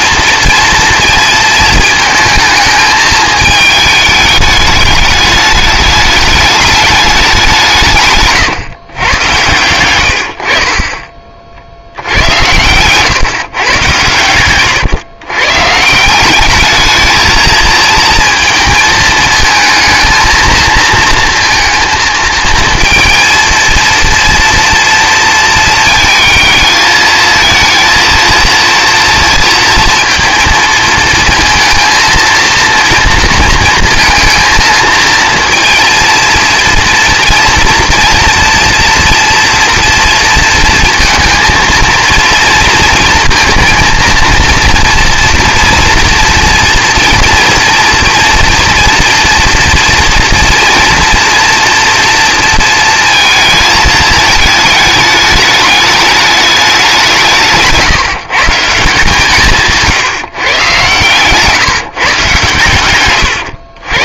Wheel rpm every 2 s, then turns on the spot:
230, 220, 210, 210, 130, 40, 110, 110, 210, 220, 230, 230, 230, 220, 230, 220, 230, 230, 230, 230, 230, 230, 240, 230, 240, 230, 230, 220, 200, 170, 130, 110.
12-14